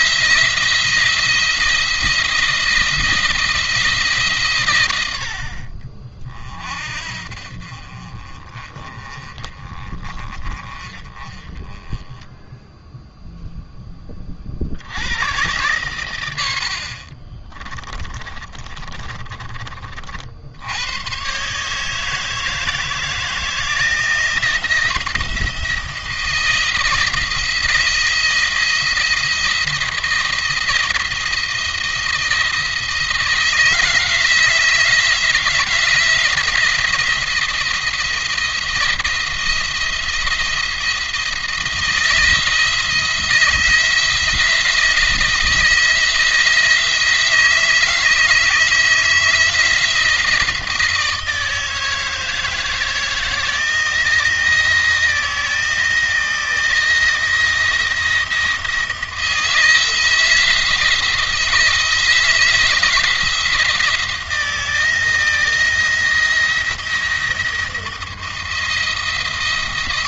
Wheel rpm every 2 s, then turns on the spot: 170, 170, 120, 40, 30, 30, 0, 80, 60, 30, 90, 160, 170, 170, 170, 170, 160, 160, 170, 170, 170, 170, 160, 160, 160, 160, 160, 170, 160, 170, 160, 170, 170, 170, 170.
16-20